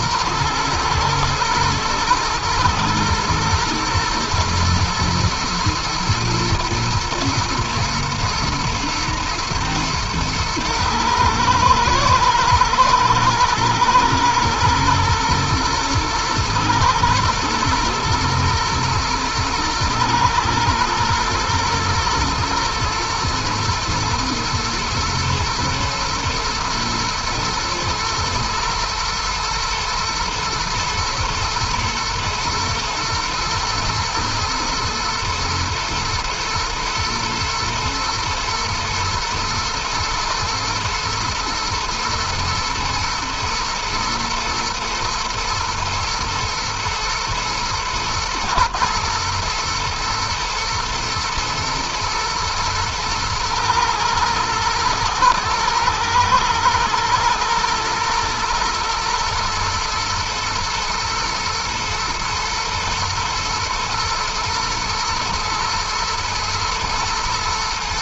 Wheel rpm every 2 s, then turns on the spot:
110, 110, 110, 110, 120, 110, 120, 120, 110, 110, 110, 110, 120, 110, 110, 120, 110, 110, 110, 110, 110, 110, 110, 110, 120, 110, 110, 120, 120, 110, 110, 110, 110, 120.
none